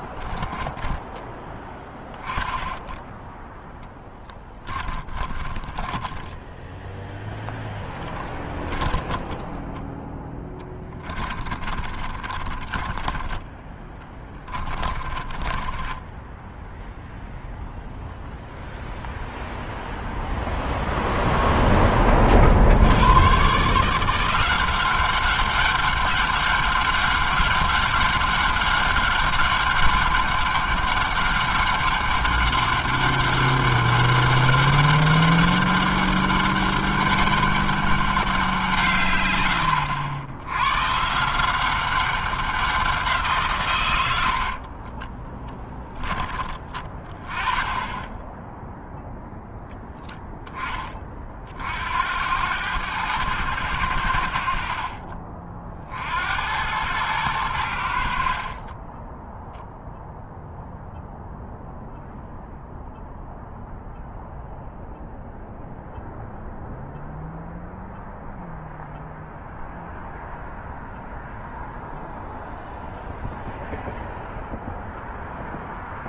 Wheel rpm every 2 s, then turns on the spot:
10, 20, 10, 10, 10, 10, 30, 10, 10, 0, 0, 40, 170, 200, 200, 200, 200, 200, 200, 180, 90, 190, 80, 20, 0, 10, 90, 70, 80, 50, 0, 0, 0, 0, 0, 0, 0, 0.
0-2 4-16